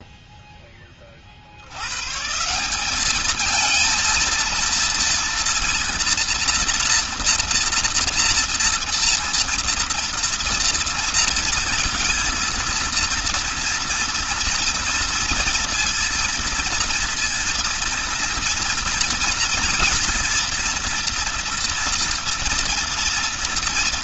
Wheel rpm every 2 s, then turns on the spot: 10, 170, 230, 230, 230, 230, 230, 230, 230, 230, 240, 230.
none